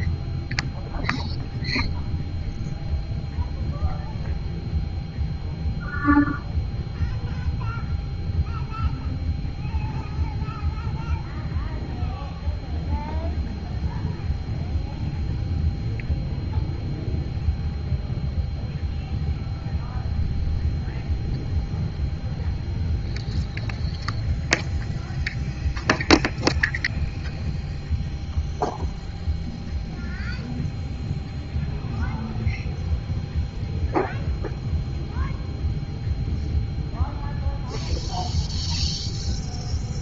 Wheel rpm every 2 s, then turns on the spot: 0, 0, 0, 0, 0, 0, 0, 0, 0, 0, 0, 0, 0, 0, 0, 0, 0, 0, 0, 0.
none